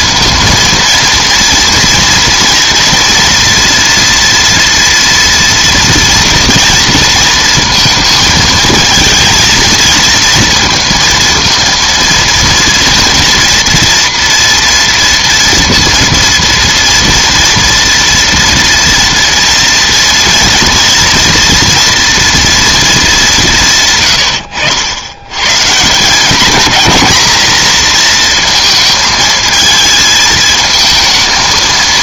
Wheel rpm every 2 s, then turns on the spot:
230, 230, 230, 230, 220, 230, 240, 230, 230, 230, 230, 230, 90, 230, 230, 220.
none